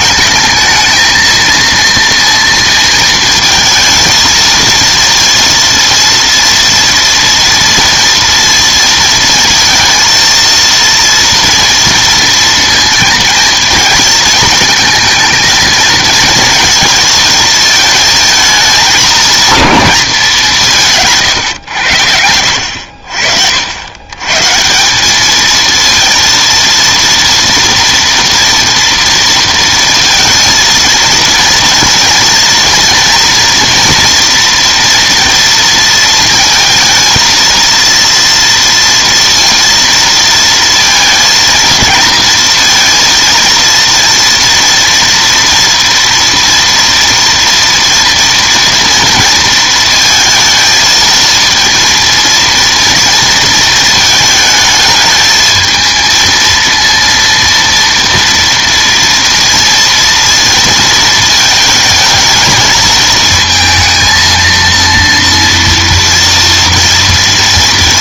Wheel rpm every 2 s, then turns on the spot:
220, 230, 230, 230, 230, 230, 230, 220, 230, 220, 170, 70, 160, 230, 230, 220, 230, 240, 230, 230, 230, 230, 240, 240, 230, 220, 230, 220, 230, 230, 230, 220, 230, 230.
none